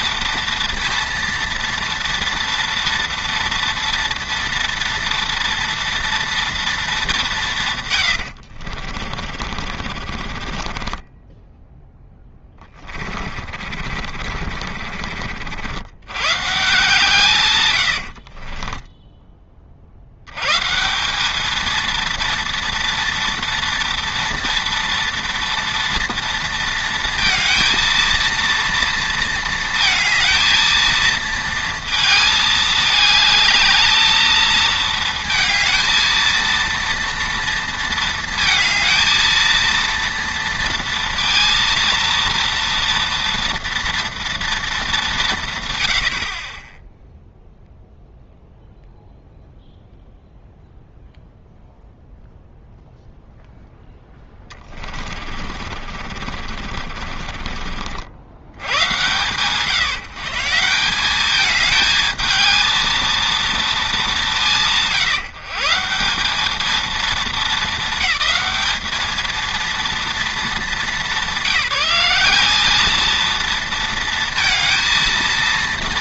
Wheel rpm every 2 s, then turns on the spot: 230, 230, 230, 230, 60, 30, 20, 50, 140, 20, 130, 230, 230, 230, 230, 230, 220, 220, 230, 230, 230, 230, 230, 30, 0, 0, 0, 20, 50, 90, 150, 220, 160, 220, 210, 210, 200, 230.
8-16 18-20 54-58